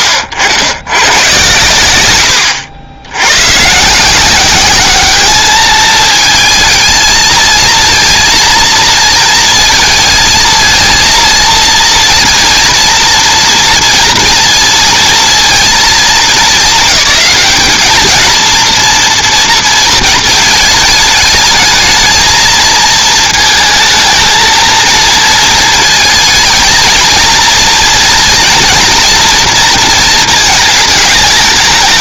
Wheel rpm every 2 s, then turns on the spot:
90, 90, 190, 220, 230, 230, 230, 230, 220, 230, 220, 220, 230, 220, 230, 220.
none